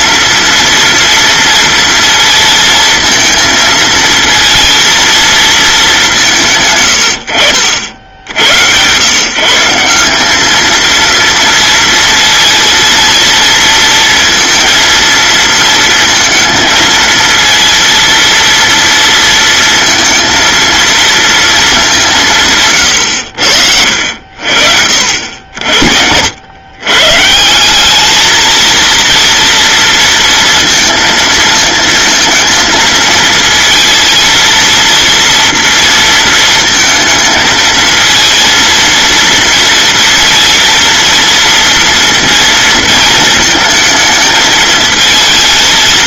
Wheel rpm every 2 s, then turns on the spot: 230, 230, 220, 100, 130, 230, 230, 230, 230, 230, 230, 100, 70, 140, 230, 220, 220, 230, 220, 230, 230, 220, 220.
none